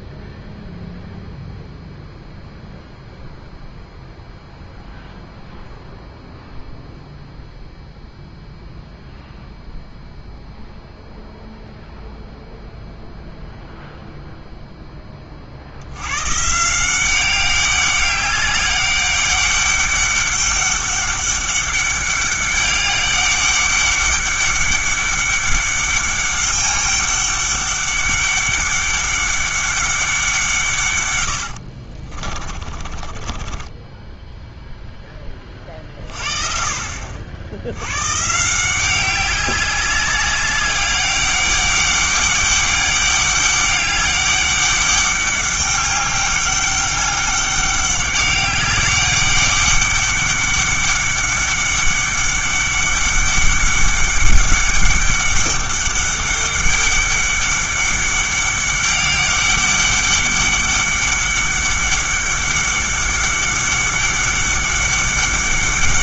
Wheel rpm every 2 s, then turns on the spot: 0, 0, 0, 0, 0, 0, 0, 10, 170, 200, 200, 200, 200, 200, 200, 140, 30, 0, 50, 180, 190, 200, 200, 200, 200, 200, 200, 200, 200, 200, 200, 200, 200.
32-34